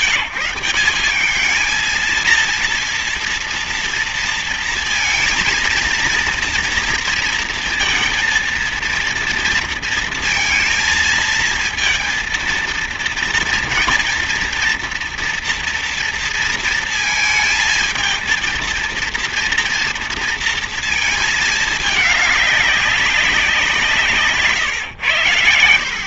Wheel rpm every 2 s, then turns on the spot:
190, 230, 230, 230, 230, 230, 230, 230, 230, 230, 230, 210, 150.
none